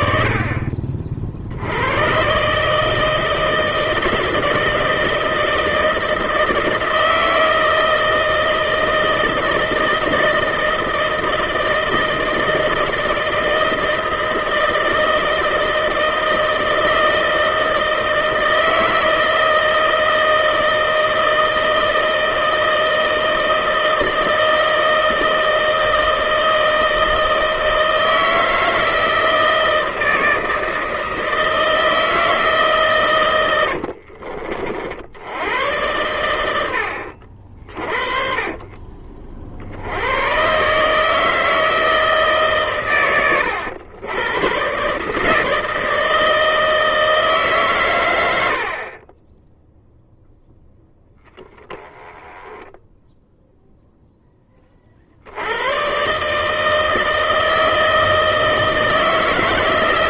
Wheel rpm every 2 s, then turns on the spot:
50, 150, 160, 160, 160, 160, 160, 160, 160, 160, 160, 160, 160, 160, 160, 160, 140, 50, 90, 30, 140, 130, 130, 160, 50, 0, 10, 40, 160, 160.
38-40